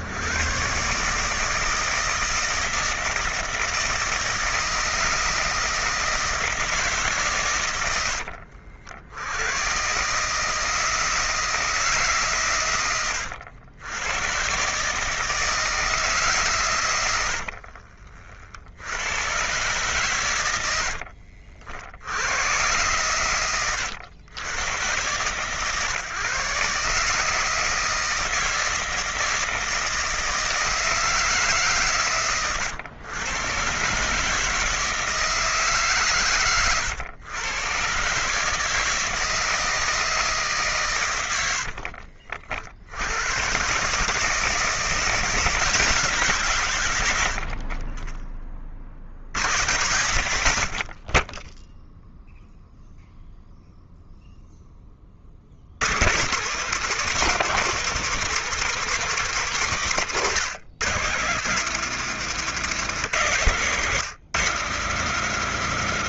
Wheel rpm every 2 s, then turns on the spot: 120, 160, 160, 160, 60, 160, 120, 130, 130, 60, 90, 110, 110, 140, 160, 160, 120, 150, 130, 150, 150, 70, 150, 160, 30, 80, 0, 0, 170, 210, 140, 160, 150.
none